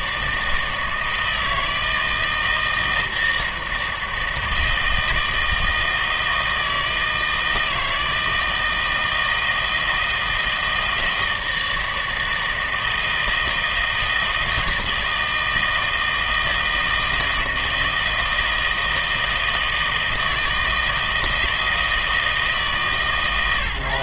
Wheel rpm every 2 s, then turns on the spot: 160, 160, 160, 160, 160, 160, 160, 160, 160, 160, 160, 140.
none